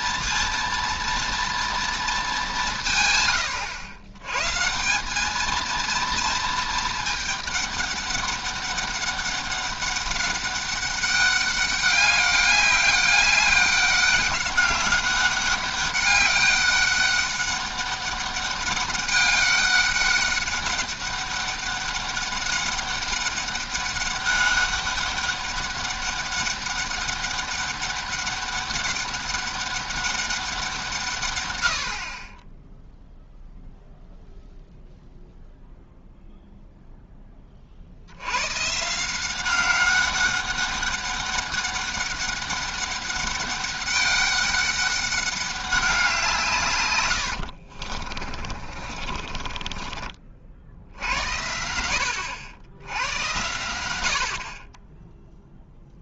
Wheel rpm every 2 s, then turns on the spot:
230, 180, 150, 220, 200, 190, 200, 200, 200, 200, 200, 200, 200, 200, 200, 180, 10, 0, 0, 130, 200, 200, 200, 130, 30, 60, 80, 30.
48-50